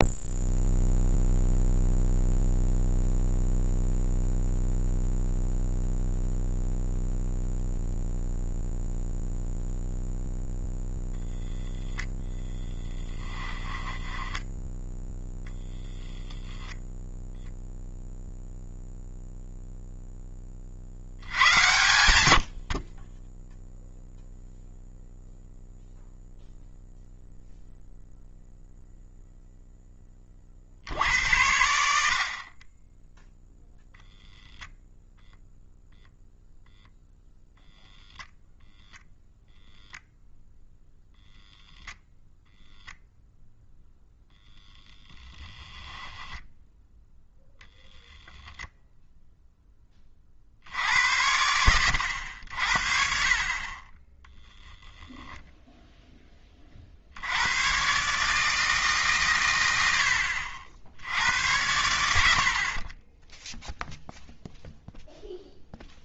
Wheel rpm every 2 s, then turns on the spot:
0, 0, 0, 0, 0, 0, 10, 0, 0, 0, 30, 60, 0, 0, 0, 50, 30, 0, 0, 0, 0, 0, 10, 0, 0, 70, 70, 10, 40, 150, 70, 50, 0.
12-14 44-46